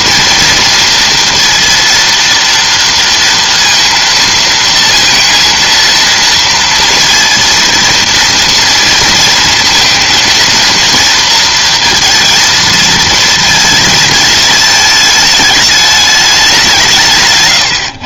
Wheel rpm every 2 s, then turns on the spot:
230, 230, 230, 230, 230, 230, 230, 220, 170.
none